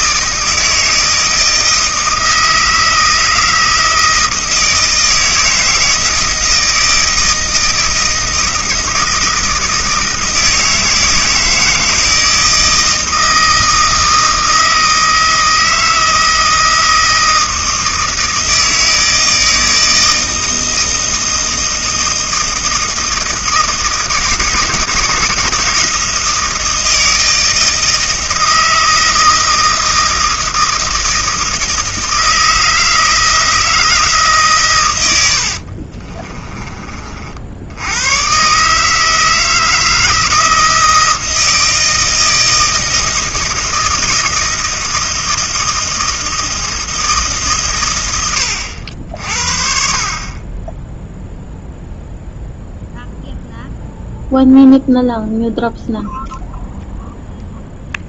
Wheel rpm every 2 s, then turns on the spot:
160, 160, 160, 160, 160, 160, 160, 160, 160, 160, 160, 160, 160, 160, 160, 160, 160, 120, 30, 140, 160, 160, 160, 160, 80, 0, 0, 0, 0.
none